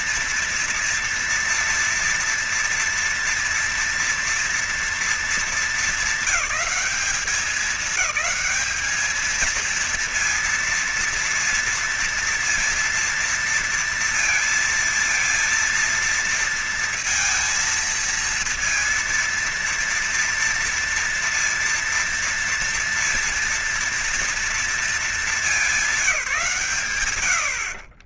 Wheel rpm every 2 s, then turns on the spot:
230, 240, 240, 210, 210, 230, 230, 230, 230, 230, 230, 230, 230, 170.
none